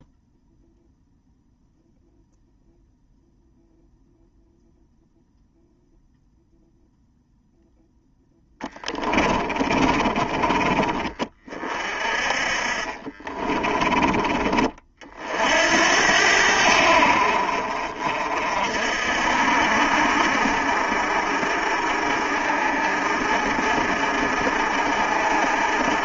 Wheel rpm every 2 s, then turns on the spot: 0, 0, 0, 0, 20, 20, 30, 40, 70, 50, 50, 50, 50.
8-10 12-14